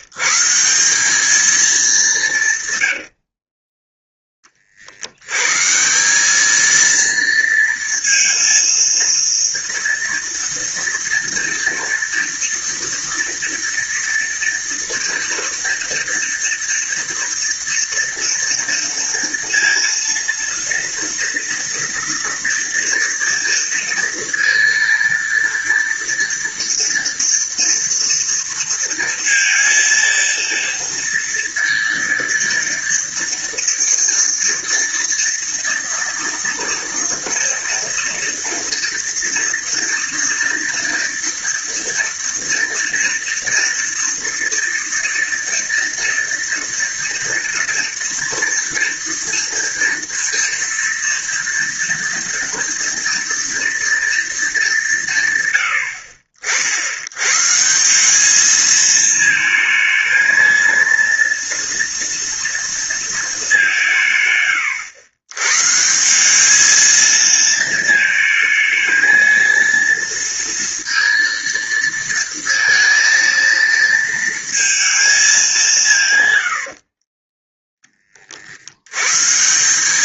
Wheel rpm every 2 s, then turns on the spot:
190, 80, 70, 230, 230, 230, 230, 230, 230, 230, 230, 230, 230, 230, 230, 230, 230, 230, 230, 240, 230, 230, 230, 230, 230, 230, 230, 170, 100, 220, 230, 220, 110, 220, 230, 230, 230, 220, 40, 110.
2-4 76-78